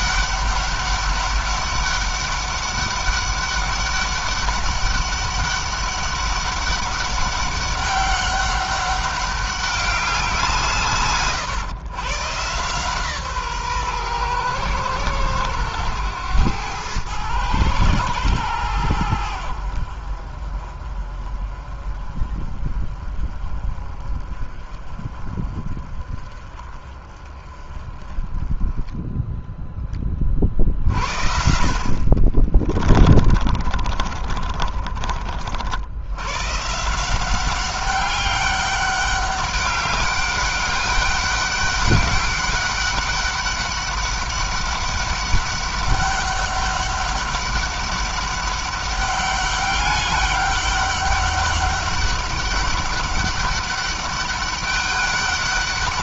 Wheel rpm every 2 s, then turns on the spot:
200, 200, 200, 200, 200, 150, 140, 110, 110, 90, 40, 30, 30, 30, 10, 50, 30, 40, 160, 200, 200, 200, 200, 200, 200, 200, 200, 200.
32-34